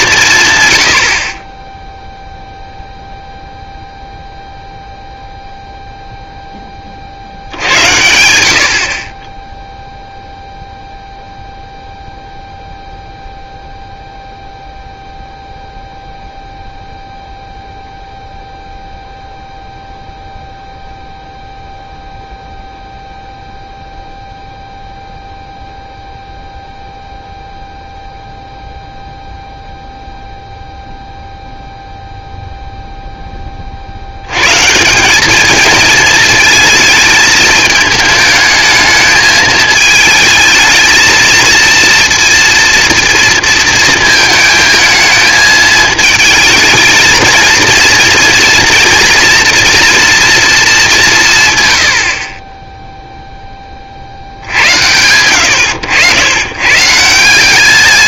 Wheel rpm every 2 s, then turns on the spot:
110, 0, 0, 20, 70, 0, 0, 0, 0, 0, 0, 0, 0, 0, 0, 0, 0, 140, 220, 220, 220, 230, 220, 220, 230, 210, 10, 80, 120.
none